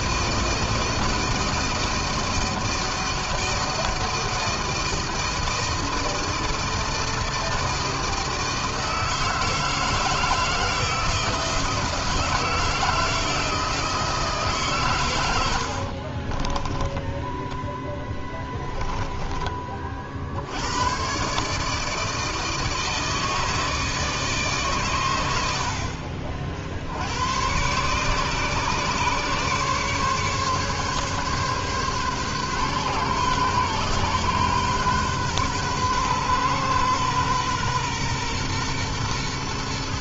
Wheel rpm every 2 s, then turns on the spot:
160, 160, 160, 160, 160, 160, 160, 110, 10, 20, 120, 160, 110, 80, 140, 140, 130, 130, 130, 120.
14-20